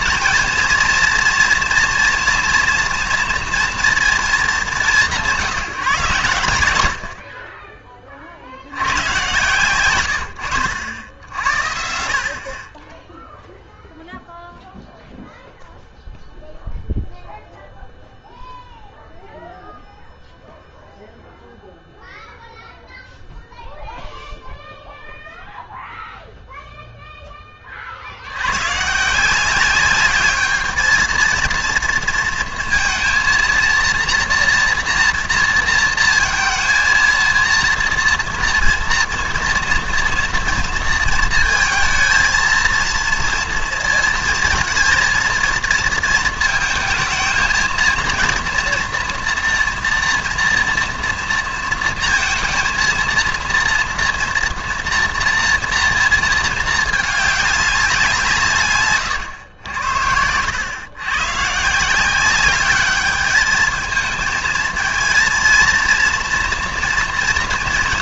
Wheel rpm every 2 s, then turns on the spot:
230, 240, 200, 80, 70, 80, 40, 0, 0, 0, 0, 0, 0, 0, 110, 220, 230, 230, 230, 230, 230, 230, 230, 230, 240, 240, 230, 230, 220, 150, 100, 200, 220, 230.
none